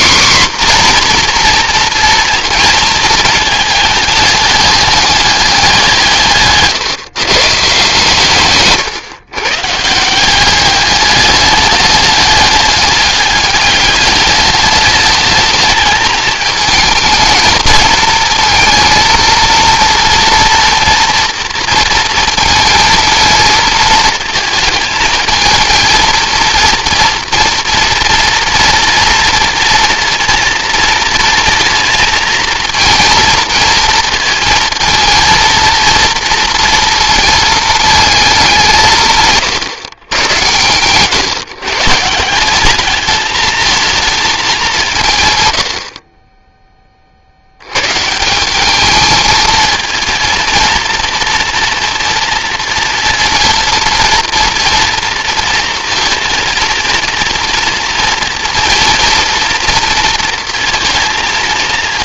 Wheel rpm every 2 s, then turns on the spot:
260, 230, 200, 140, 130, 200, 210, 210, 220, 230, 230, 230, 220, 230, 230, 230, 230, 230, 230, 170, 110, 200, 180, 30, 200, 230, 230, 230, 230, 240, 230.
none